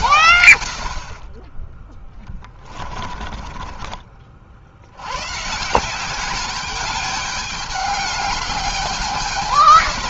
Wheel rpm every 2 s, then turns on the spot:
100, 20, 60, 200, 210.
2-4